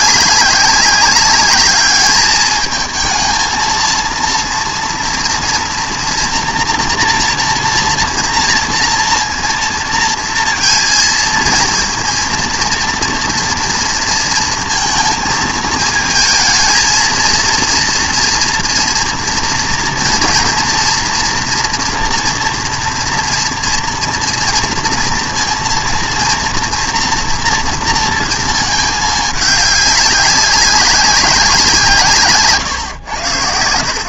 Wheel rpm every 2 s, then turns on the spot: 200, 220, 240, 230, 230, 230, 230, 220, 220, 240, 240, 230, 230, 230, 220, 200, 120.
none